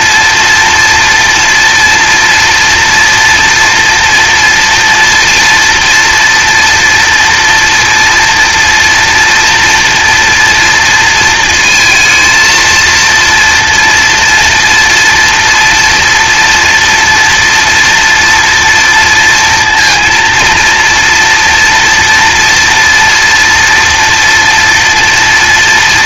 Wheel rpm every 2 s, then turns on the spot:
230, 230, 240, 240, 240, 230, 230, 230, 230, 230, 230, 230, 230.
none